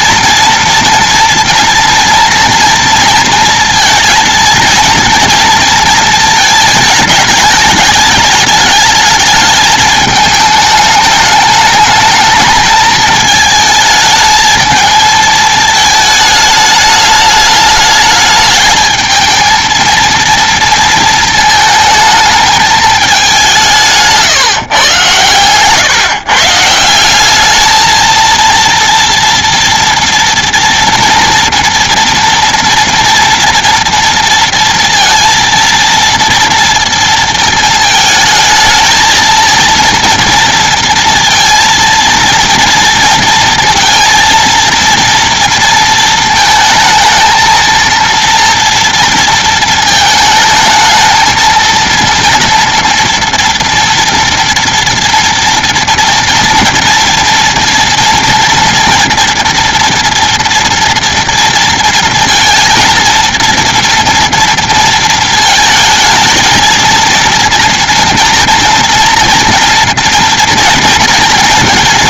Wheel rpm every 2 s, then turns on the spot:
230, 230, 230, 220, 210, 210, 210, 220, 210, 220, 230, 210, 130, 160, 230, 230, 240, 230, 230, 220, 230, 230, 230, 220, 240, 220, 230, 230, 230, 240, 230, 230, 230, 230, 230, 240.
none